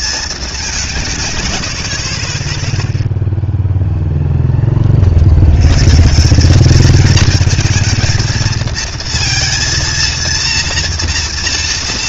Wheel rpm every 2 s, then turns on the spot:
170, 0, 30, 220, 220, 230.
none